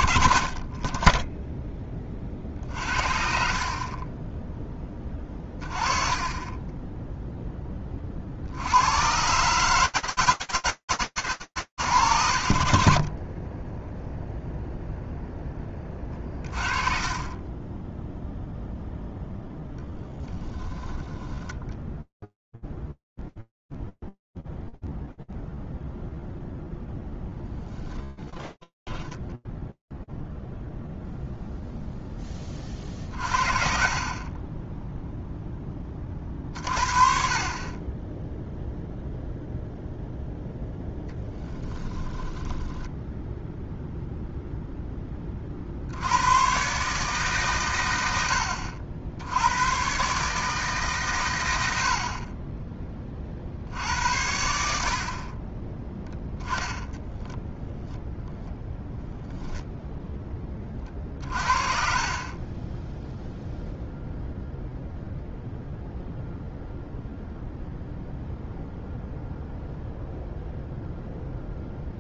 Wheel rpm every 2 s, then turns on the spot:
30, 40, 10, 20, 50, 140, 10, 0, 30, 0, 10, 0, 10, 0, 40, 10, 40, 0, 0, 10, 0, 40, 140, 100, 110, 20, 60, 10, 0, 30, 10, 0, 0, 0, 0, 0.
4-8 12-14 20-22 38-40 54-56